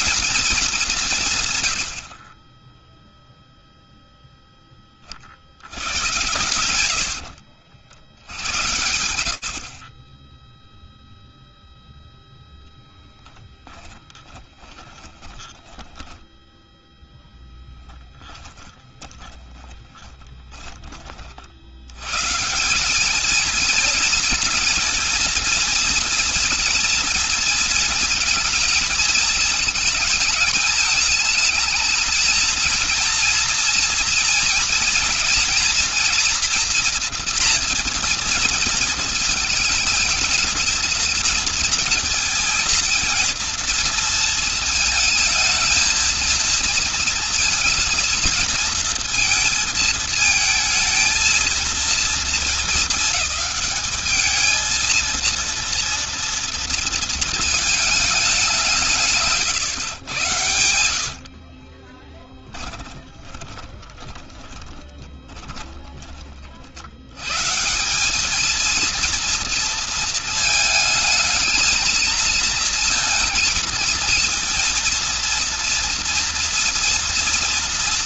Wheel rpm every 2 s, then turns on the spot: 210, 10, 20, 100, 90, 0, 10, 20, 10, 20, 50, 220, 230, 240, 220, 220, 230, 230, 240, 220, 230, 230, 220, 220, 230, 230, 220, 230, 220, 130, 50, 10, 20, 90, 230, 220, 230, 230, 230.
12-16 18-20 58-66